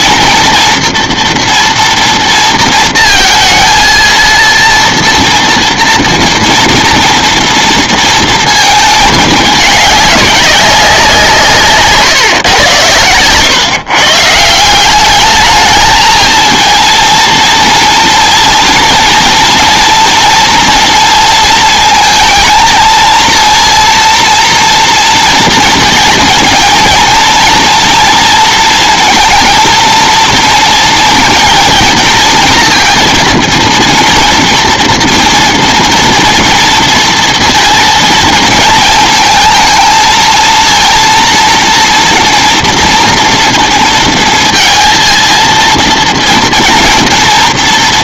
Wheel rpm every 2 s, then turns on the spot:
230, 230, 230, 230, 220, 190, 110, 180, 230, 230, 230, 220, 230, 230, 230, 230, 230, 240, 230, 230, 230, 230, 230, 230.
none